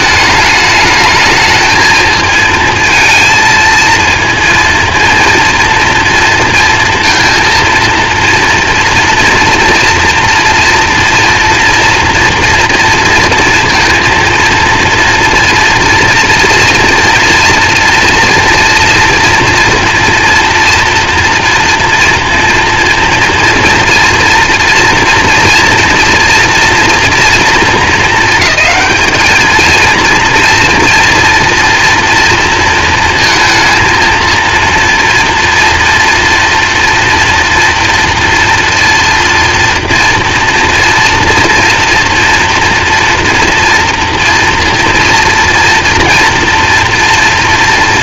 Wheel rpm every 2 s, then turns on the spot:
210, 230, 230, 230, 230, 230, 230, 230, 230, 230, 230, 230, 240, 230, 220, 230, 230, 230, 230, 230, 230, 240, 230, 240.
none